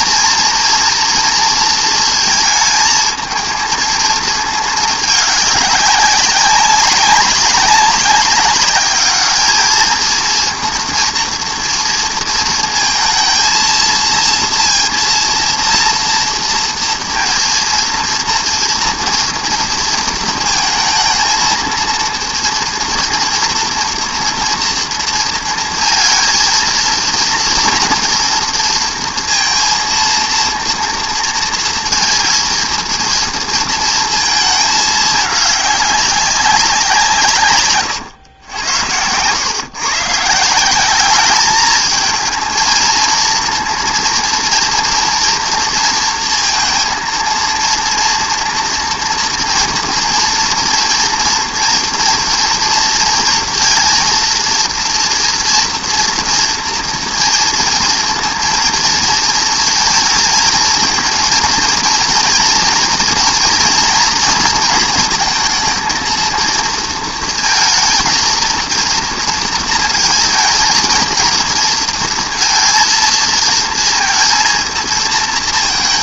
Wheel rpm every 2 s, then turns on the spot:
240, 220, 220, 200, 210, 230, 230, 230, 230, 230, 230, 230, 230, 230, 230, 230, 230, 210, 170, 90, 200, 230, 230, 230, 240, 230, 230, 230, 230, 230, 220, 240, 220, 230, 230, 230, 220, 220.
none